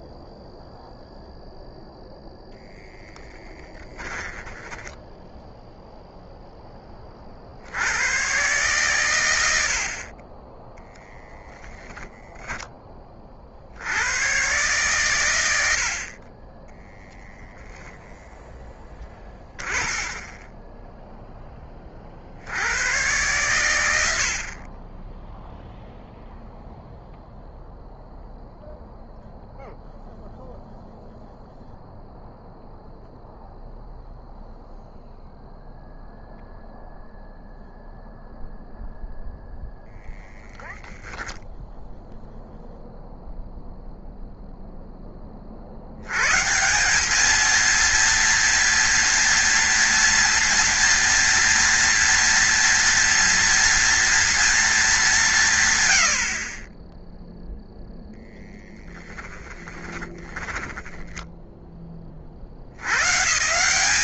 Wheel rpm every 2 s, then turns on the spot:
0, 10, 10, 0, 110, 10, 10, 120, 10, 10, 20, 80, 40, 0, 0, 0, 0, 0, 0, 0, 10, 0, 0, 160, 240, 230, 230, 220, 30, 10, 10, 80.
18-22 60-62